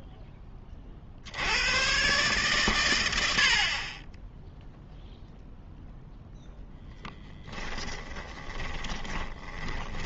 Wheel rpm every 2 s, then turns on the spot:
20, 130, 0, 0, 20.
8-10